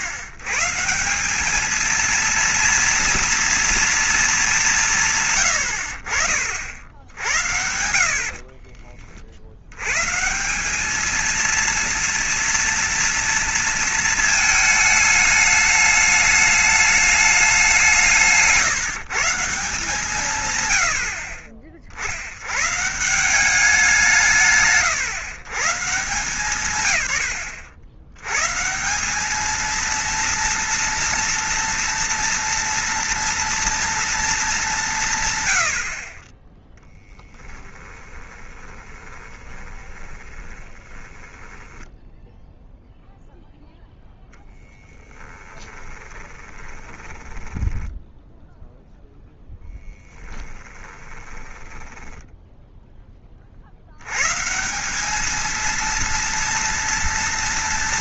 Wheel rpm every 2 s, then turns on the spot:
130, 230, 210, 60, 30, 190, 230, 220, 210, 160, 110, 130, 140, 150, 140, 230, 230, 210, 10, 20, 20, 0, 10, 20, 0, 10, 0, 160, 230.
8-10 38-42 44-48 50-52